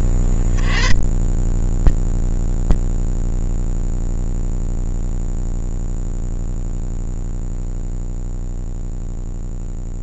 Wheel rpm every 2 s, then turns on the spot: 60, 160, 160, 140, 10.
none